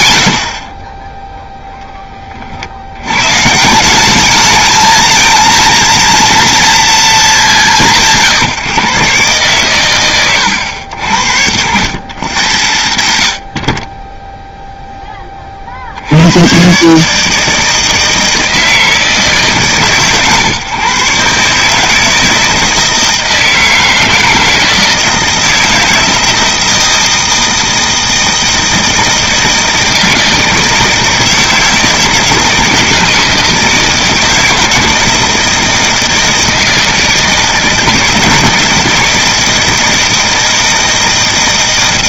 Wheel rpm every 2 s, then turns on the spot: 40, 60, 210, 230, 150, 100, 110, 0, 120, 160, 130, 160, 160, 160, 160, 160, 160, 160, 160, 160, 160.
none